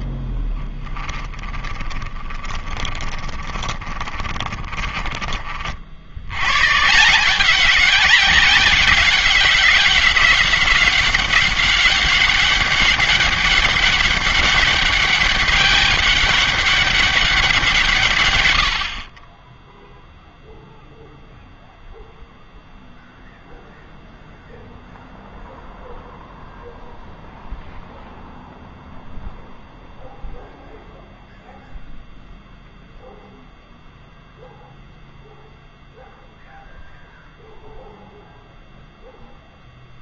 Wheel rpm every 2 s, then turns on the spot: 20, 20, 30, 140, 190, 190, 200, 200, 200, 80, 0, 0, 0, 0, 0, 0, 0, 0, 0, 0.
0-6